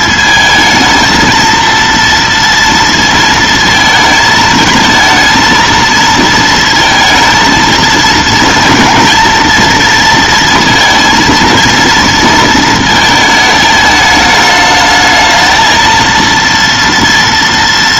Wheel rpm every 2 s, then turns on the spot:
220, 230, 220, 230, 230, 230, 230, 210, 230.
none